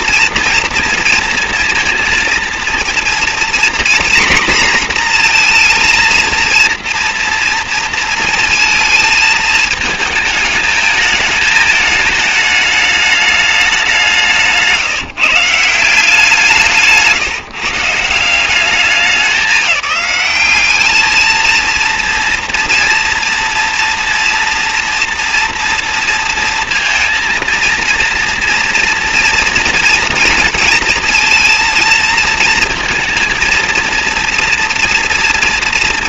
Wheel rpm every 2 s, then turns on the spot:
230, 230, 240, 230, 220, 220, 220, 170, 160, 180, 210, 230, 230, 230, 230, 230, 230, 240.
none